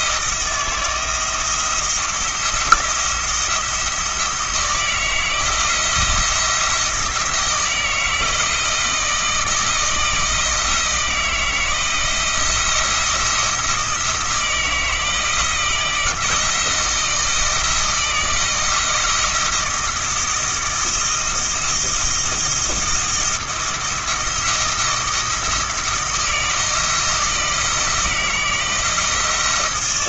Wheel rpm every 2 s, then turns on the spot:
170, 170, 170, 160, 160, 160, 170, 160, 160, 170, 160, 170, 170, 160, 160.
none